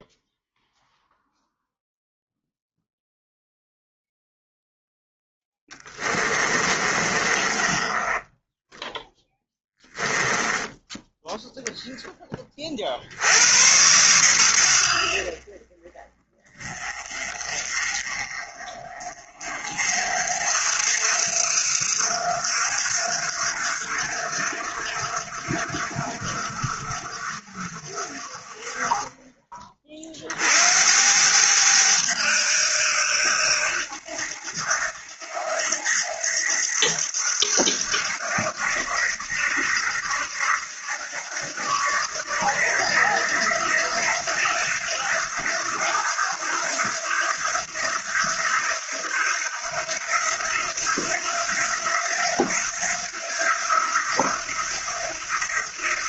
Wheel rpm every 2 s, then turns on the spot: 0, 0, 0, 30, 10, 10, 40, 90, 30, 40, 60, 60, 60, 60, 40, 70, 80, 80, 80, 80, 80, 80, 90, 80, 80, 90, 90, 80.
6-12